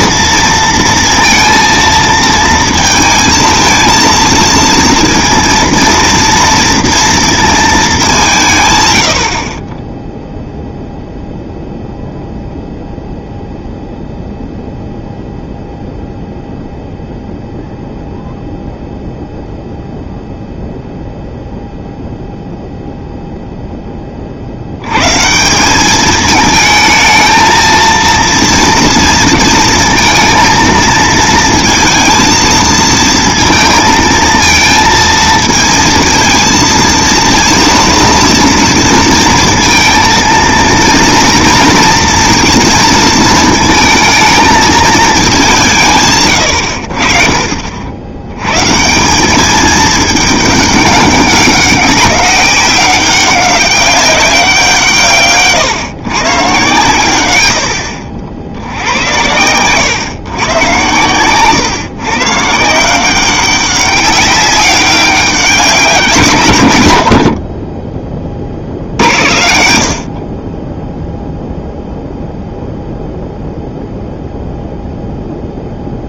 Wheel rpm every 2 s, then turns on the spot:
230, 230, 230, 230, 140, 0, 0, 0, 0, 0, 0, 0, 60, 220, 230, 230, 230, 230, 230, 230, 230, 230, 220, 110, 120, 210, 190, 180, 140, 90, 120, 150, 190, 120, 80, 30, 0, 0.
none